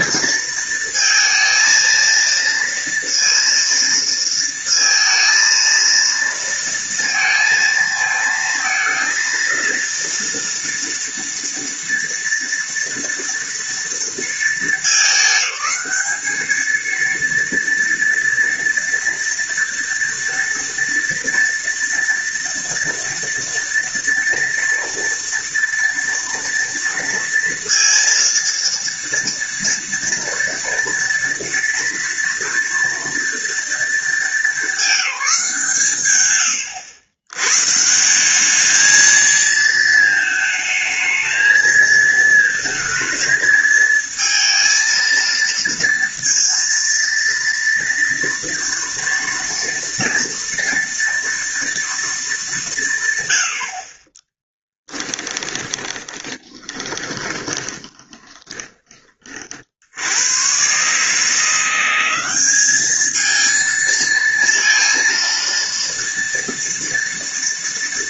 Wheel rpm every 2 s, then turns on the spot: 230, 230, 230, 230, 230, 230, 230, 220, 220, 230, 230, 230, 230, 230, 230, 230, 230, 220, 110, 200, 220, 220, 230, 230, 230, 230, 200, 20, 20, 20, 120, 200, 230, 230.
54-58